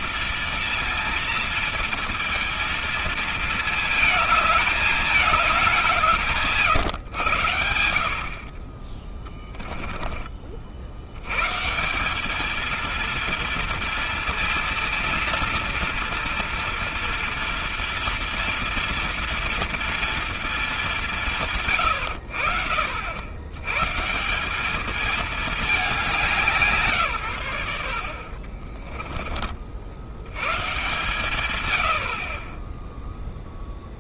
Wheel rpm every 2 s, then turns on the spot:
230, 230, 210, 140, 40, 60, 230, 230, 230, 230, 200, 60, 200, 150, 30, 130, 20.
28-30